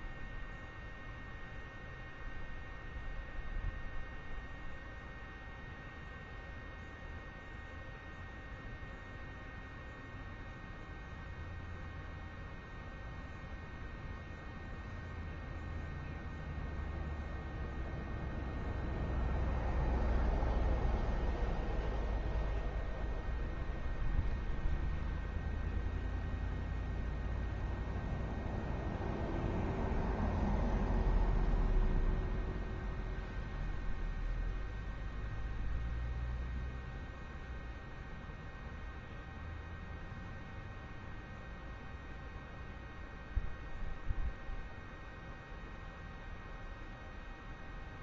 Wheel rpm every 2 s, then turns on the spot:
0, 0, 0, 0, 0, 0, 0, 0, 0, 0, 0, 0, 0, 0, 0, 0, 0, 0, 0, 0, 0, 0, 0, 0.
none